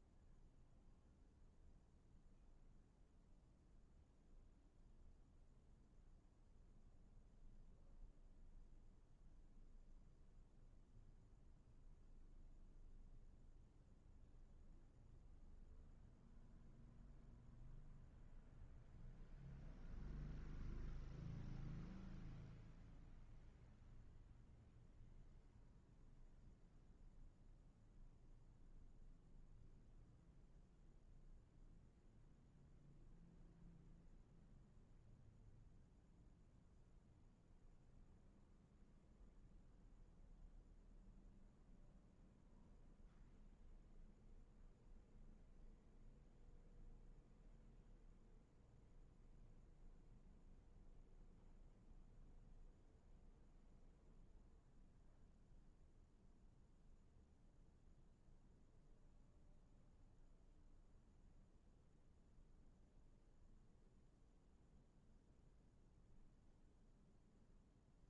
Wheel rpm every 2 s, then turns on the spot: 0, 0, 0, 0, 0, 0, 0, 0, 0, 0, 0, 0, 0, 0, 0, 0, 0, 0, 0, 0, 0, 0, 0, 0, 0, 0, 0, 0, 0, 0, 0, 0, 0, 0.
none